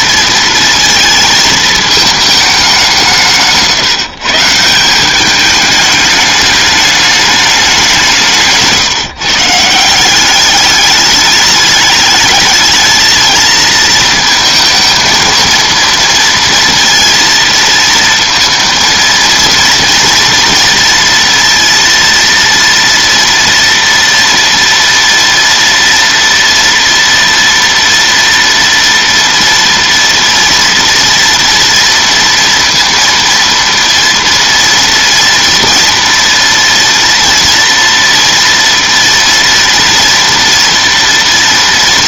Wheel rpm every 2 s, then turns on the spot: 230, 200, 160, 210, 150, 200, 220, 230, 230, 230, 230, 230, 230, 230, 230, 230, 230, 230, 230, 230, 230.
8-10